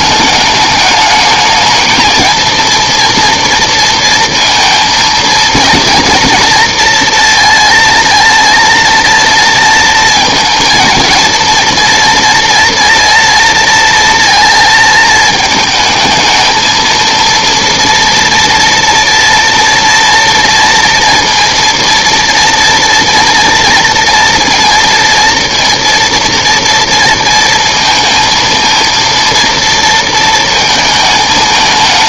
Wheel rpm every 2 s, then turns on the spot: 210, 230, 230, 230, 230, 220, 230, 230, 220, 230, 230, 230, 230, 240, 230, 230.
none